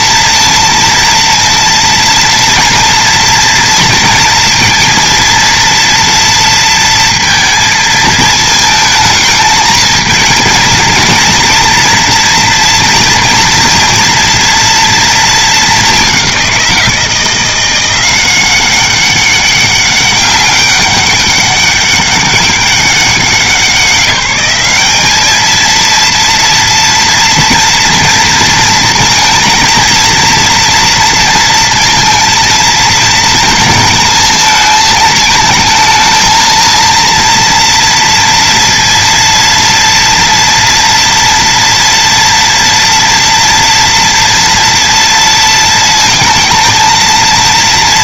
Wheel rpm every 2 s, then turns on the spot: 230, 230, 230, 230, 220, 230, 230, 230, 180, 190, 200, 200, 200, 230, 230, 230, 230, 210, 230, 230, 230, 230, 230, 230.
none